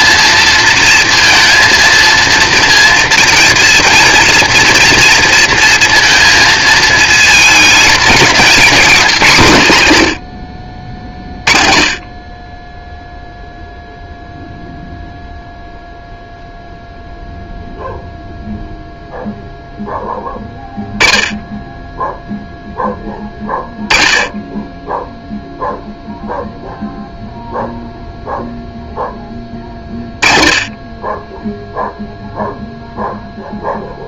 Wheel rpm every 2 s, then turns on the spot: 230, 230, 230, 220, 210, 50, 10, 0, 0, 0, 0, 10, 10, 0, 0, 30, 0.
none